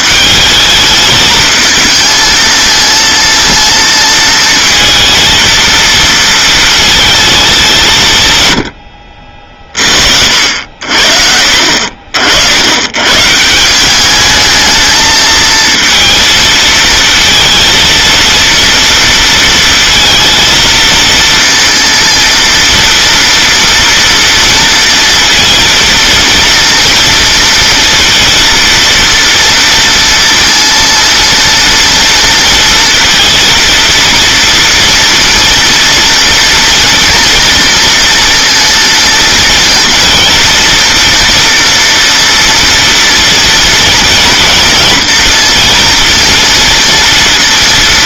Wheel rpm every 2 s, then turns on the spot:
210, 220, 220, 220, 80, 70, 100, 220, 230, 230, 230, 230, 230, 230, 230, 230, 230, 230, 230, 230, 230, 230, 230, 240.
8-10